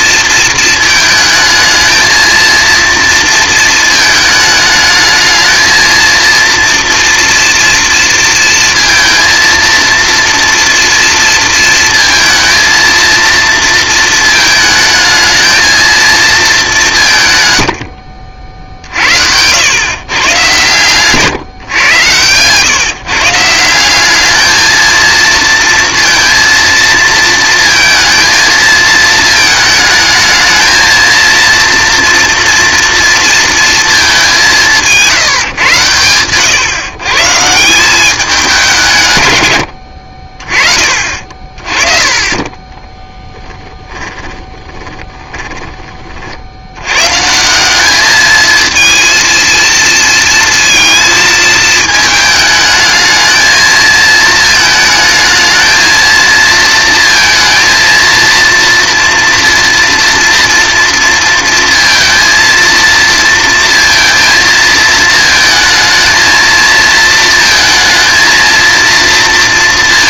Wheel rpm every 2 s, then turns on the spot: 220, 230, 220, 230, 230, 230, 230, 220, 190, 60, 120, 140, 220, 230, 220, 220, 230, 170, 130, 170, 30, 20, 30, 70, 220, 230, 220, 220, 230, 230, 230, 230, 230, 230, 230.
40-46